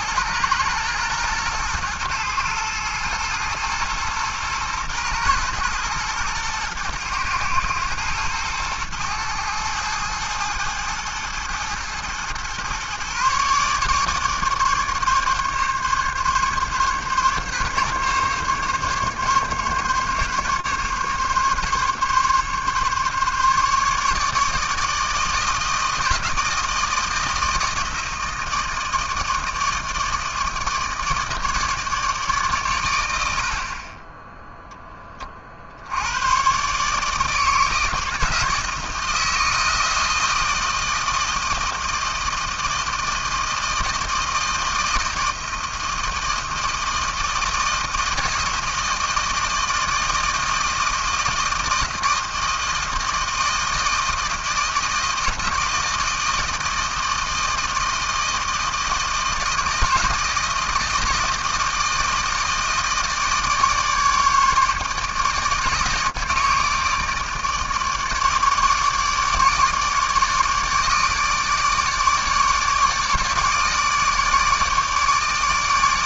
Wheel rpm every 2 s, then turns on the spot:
110, 120, 110, 110, 110, 110, 120, 150, 140, 140, 140, 140, 150, 160, 160, 160, 130, 0, 130, 160, 160, 160, 160, 160, 160, 160, 160, 160, 160, 160, 160, 160, 150, 160, 150, 150, 150, 150.
none